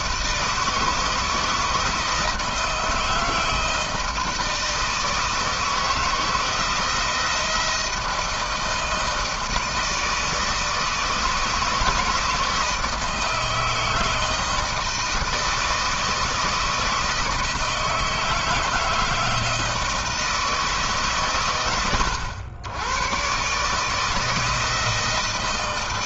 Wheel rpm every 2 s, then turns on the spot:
160, 160, 160, 170, 160, 160, 160, 160, 160, 160, 130, 110, 160.
none